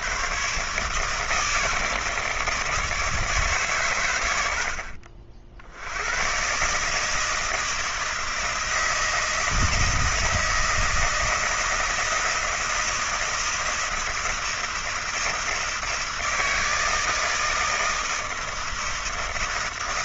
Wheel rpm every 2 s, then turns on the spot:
150, 160, 70, 140, 160, 170, 160, 160, 160, 160.
none